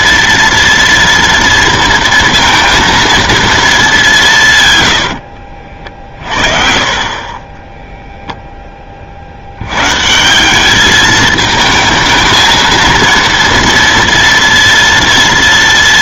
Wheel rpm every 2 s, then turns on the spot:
230, 230, 140, 40, 10, 190, 230, 230.
none